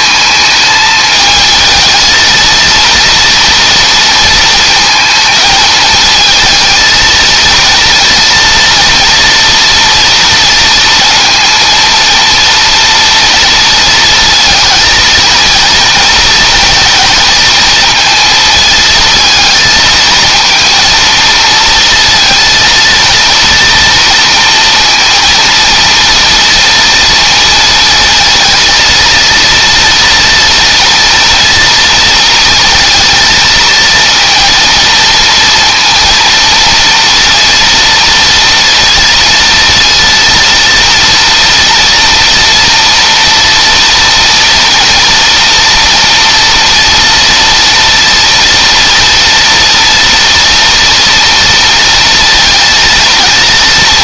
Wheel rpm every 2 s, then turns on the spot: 220, 230, 220, 230, 230, 230, 230, 230, 230, 220, 230, 230, 230, 230, 230, 240, 230, 230, 230, 230, 230, 240, 230, 230, 230, 230, 230.
none